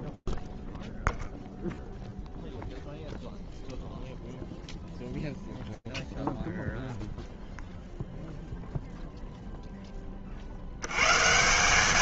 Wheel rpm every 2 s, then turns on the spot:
0, 0, 0, 0, 0, 180.
none